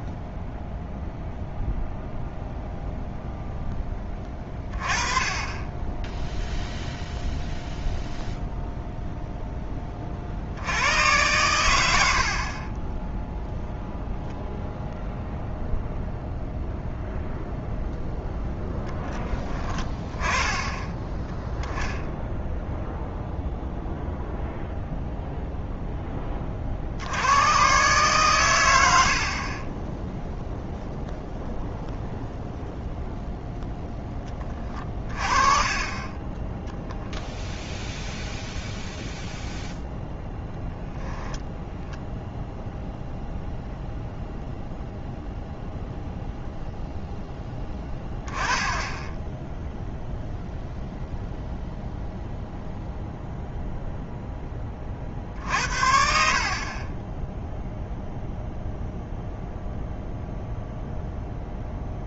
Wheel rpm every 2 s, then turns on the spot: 0, 20, 0, 0, 20, 90, 0, 0, 0, 10, 10, 0, 0, 50, 80, 0, 0, 30, 10, 0, 0, 0, 0, 10, 10, 0, 0, 50, 20, 0, 0.
none